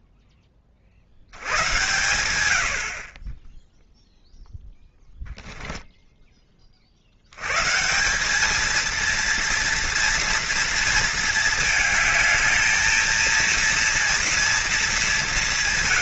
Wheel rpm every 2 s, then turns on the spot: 110, 10, 0, 110, 230, 220, 230, 210.
none